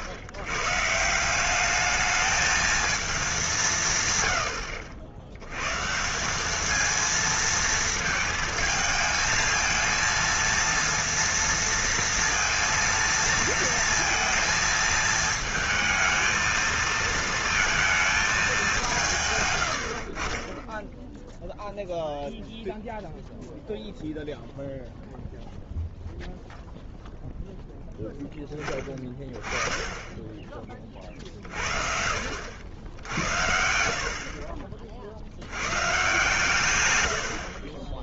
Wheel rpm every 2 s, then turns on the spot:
110, 220, 90, 210, 220, 230, 230, 220, 220, 200, 20, 0, 0, 0, 10, 20, 80, 40, 150.
none